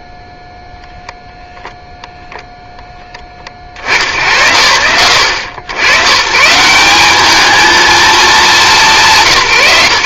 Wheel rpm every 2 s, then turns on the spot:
0, 0, 70, 190, 210.
none